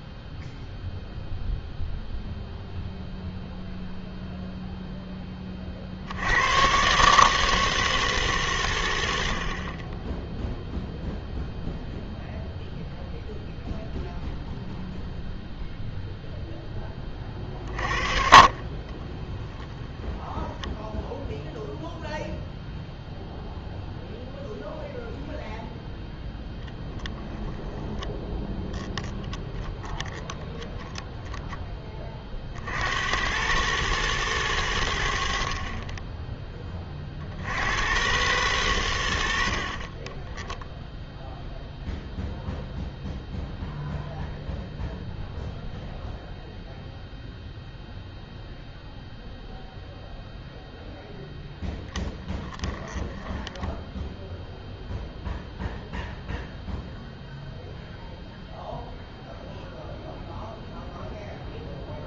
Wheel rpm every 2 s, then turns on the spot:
0, 0, 0, 120, 120, 0, 0, 0, 10, 30, 10, 0, 0, 10, 20, 20, 70, 90, 20, 90, 0, 0, 0, 0, 0, 0, 10, 0, 0, 0, 0.
18-22 26-32 52-54